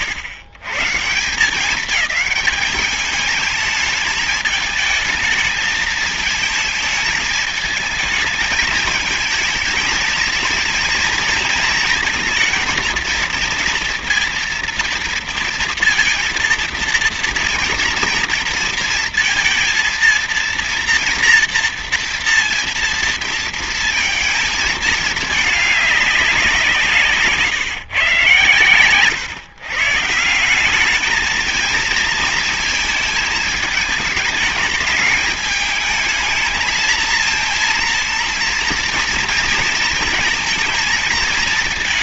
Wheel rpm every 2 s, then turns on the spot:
160, 210, 220, 220, 220, 230, 220, 230, 230, 230, 230, 230, 220, 180, 120, 190, 230, 220, 220, 230, 220.
28-30